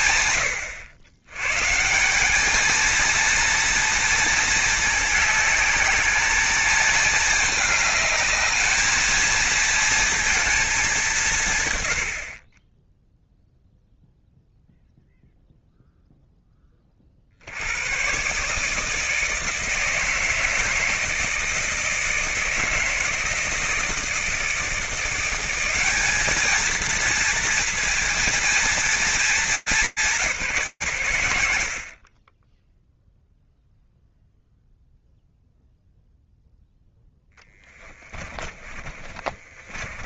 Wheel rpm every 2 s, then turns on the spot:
110, 230, 220, 210, 220, 170, 0, 0, 60, 160, 160, 160, 180, 230, 210, 50, 0, 0, 10, 30.
36-40